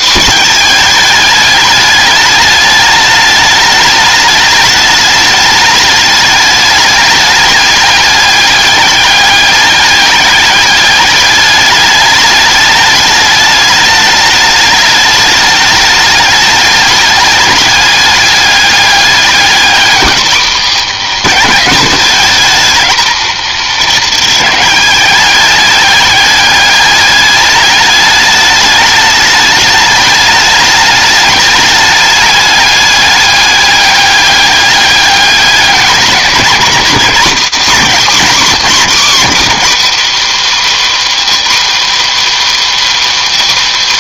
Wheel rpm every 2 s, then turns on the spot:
220, 210, 210, 210, 210, 210, 210, 210, 210, 200, 230, 210, 200, 210, 210, 210, 200, 200, 220, 230, 290, 290.
none